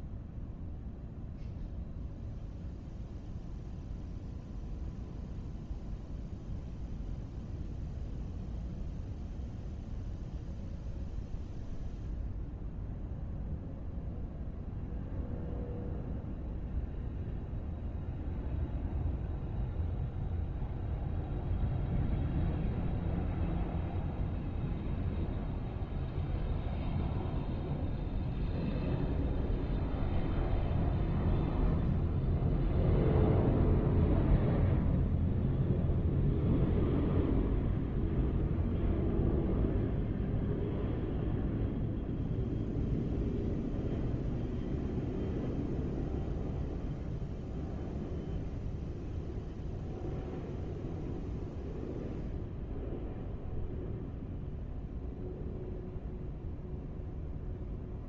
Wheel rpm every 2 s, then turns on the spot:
0, 0, 0, 0, 0, 0, 0, 0, 0, 0, 0, 0, 0, 0, 0, 0, 0, 0, 0, 0, 0, 0, 0, 0, 0, 0, 0, 0, 0.
none